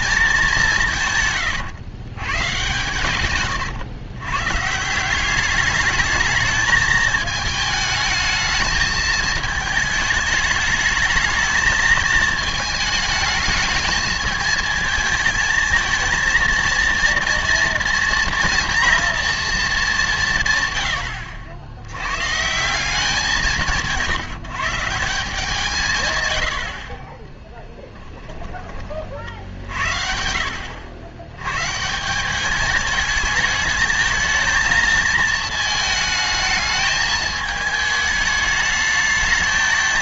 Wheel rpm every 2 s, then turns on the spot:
180, 120, 150, 220, 220, 210, 220, 220, 230, 240, 100, 180, 150, 60, 20, 80, 210, 230, 220, 220.
none